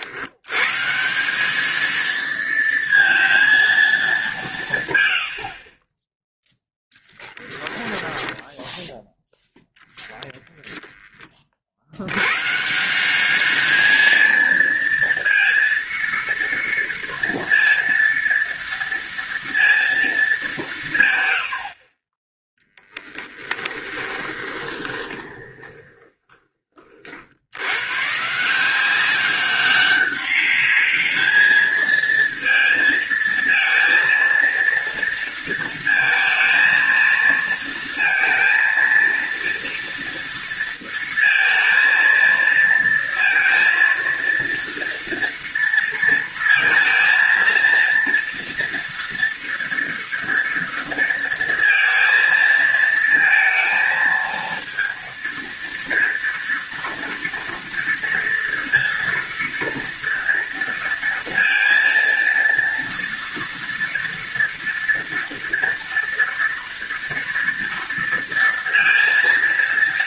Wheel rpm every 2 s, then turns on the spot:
130, 230, 150, 0, 0, 10, 170, 230, 230, 230, 170, 10, 20, 40, 180, 210, 220, 230, 230, 230, 230, 230, 230, 230, 230, 230, 220, 230, 230, 230, 230, 230, 230, 230, 230.
22-26